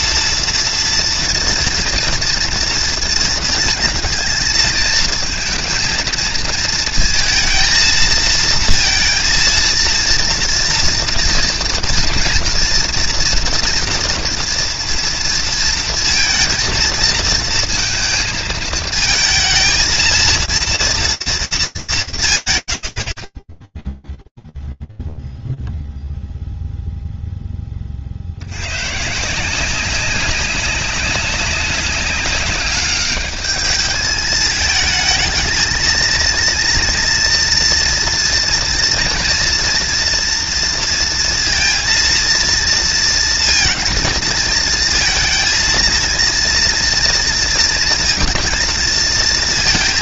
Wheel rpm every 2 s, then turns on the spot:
230, 230, 220, 230, 230, 230, 230, 230, 230, 220, 230, 50, 0, 0, 130, 190, 200, 220, 230, 230, 230, 230, 220, 230, 230.
none